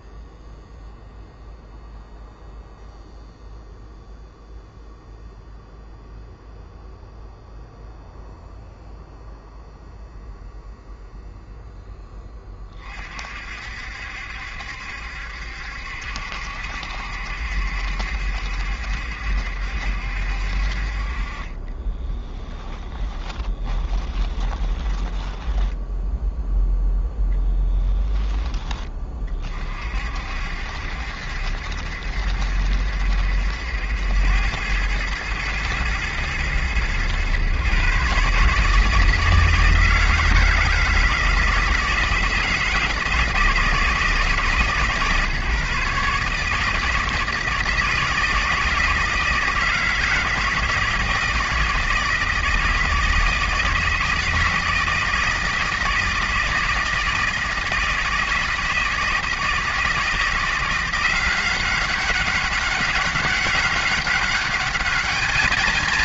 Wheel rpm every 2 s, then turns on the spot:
0, 0, 0, 0, 0, 0, 30, 70, 70, 70, 50, 10, 10, 0, 20, 70, 70, 100, 110, 150, 160, 160, 140, 160, 160, 160, 160, 160, 160, 160, 180, 200, 210.
22-26